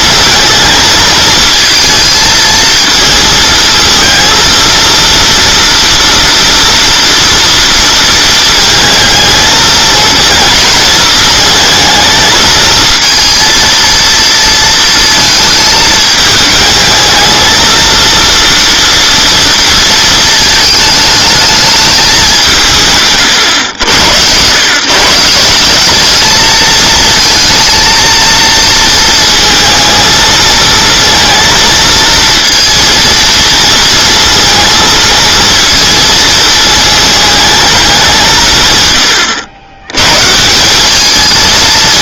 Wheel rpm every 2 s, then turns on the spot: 220, 220, 230, 230, 230, 230, 220, 230, 220, 230, 220, 170, 130, 220, 230, 220, 230, 230, 220, 140, 180.
none